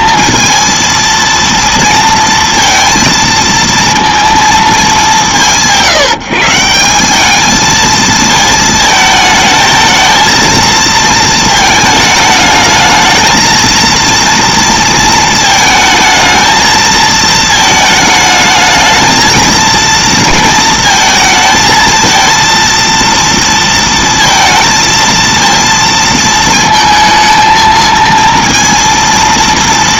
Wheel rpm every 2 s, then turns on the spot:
230, 230, 220, 180, 220, 230, 220, 230, 220, 220, 220, 230, 230, 230, 230.
none